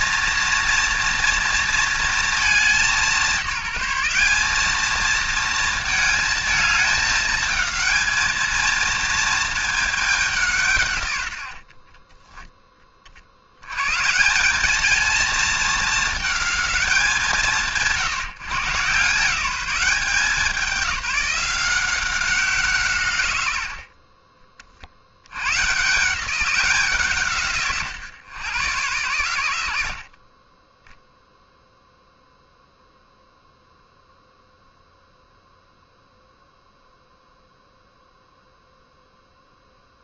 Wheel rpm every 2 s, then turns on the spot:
230, 210, 210, 220, 230, 140, 40, 220, 180, 140, 190, 150, 70, 170, 110, 20, 0, 0, 0, 0.
30-32